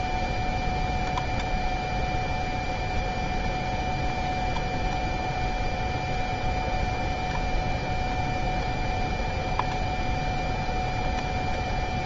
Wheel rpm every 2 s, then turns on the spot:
0, 0, 0, 0, 0, 0.
none